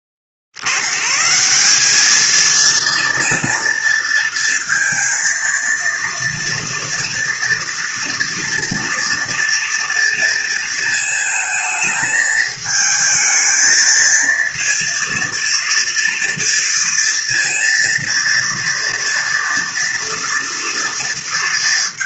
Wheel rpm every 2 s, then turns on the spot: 50, 230, 230, 230, 230, 230, 220, 230, 230, 230, 240.
none